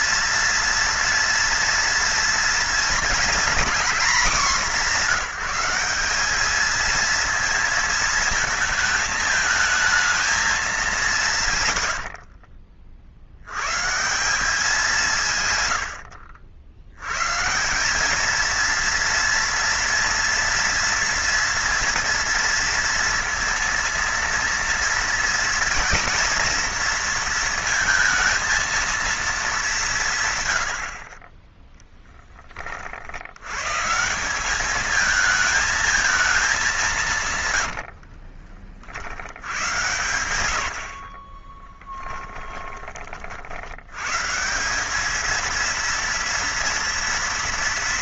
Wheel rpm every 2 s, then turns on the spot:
230, 230, 220, 220, 220, 210, 50, 190, 80, 230, 230, 230, 230, 230, 230, 90, 20, 200, 190, 30, 100, 30, 180, 230.
42-44